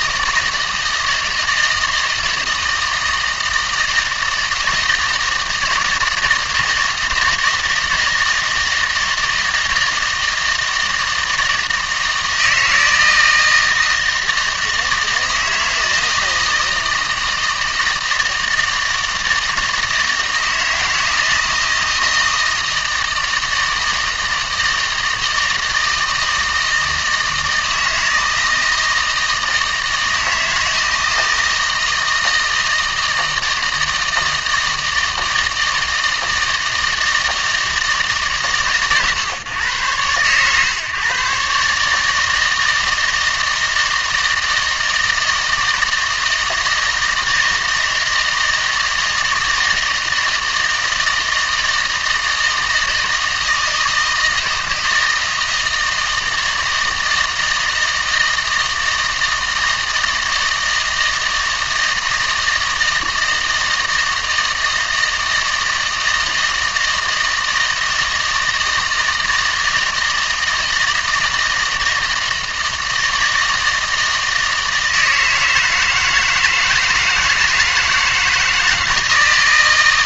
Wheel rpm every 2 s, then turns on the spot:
160, 160, 160, 160, 160, 160, 160, 160, 160, 160, 160, 160, 160, 160, 160, 160, 160, 160, 160, 120, 130, 160, 160, 160, 160, 160, 160, 160, 160, 160, 160, 160, 160, 160, 160, 160, 160, 160, 160, 160.
none